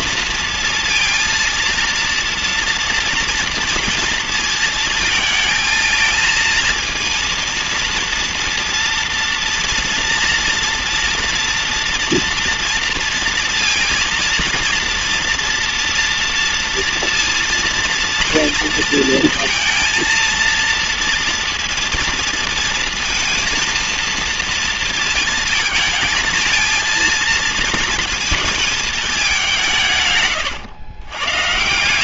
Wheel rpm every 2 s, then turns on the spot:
230, 230, 220, 230, 230, 240, 230, 230, 230, 230, 230, 230, 230, 230, 220, 100.
none